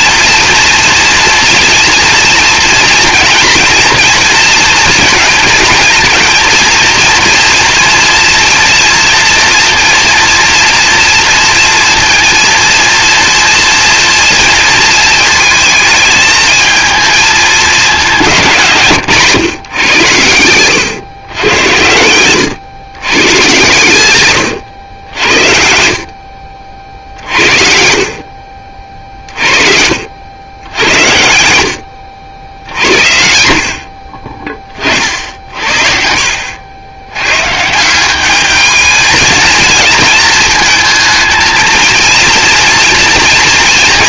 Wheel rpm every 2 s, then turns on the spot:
230, 240, 230, 230, 230, 230, 230, 230, 220, 180, 100, 110, 100, 60, 50, 90, 70, 30, 80, 210, 220, 230.
none